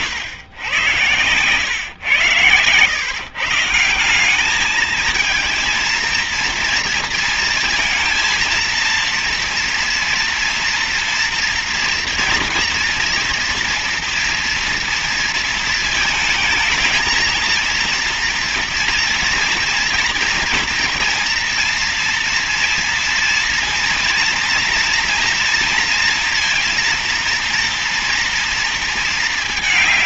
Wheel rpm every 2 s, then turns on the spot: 100, 110, 200, 230, 230, 230, 230, 230, 220, 230, 240, 230, 230, 230, 230.
none